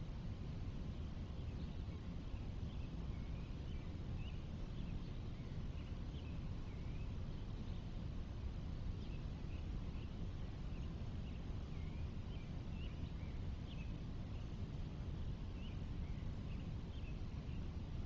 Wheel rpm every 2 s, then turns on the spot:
0, 0, 0, 0, 0, 0, 0, 0, 0.
none